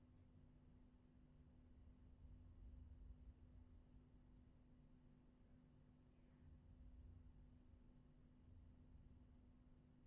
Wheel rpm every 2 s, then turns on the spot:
0, 0, 0, 0, 0.
none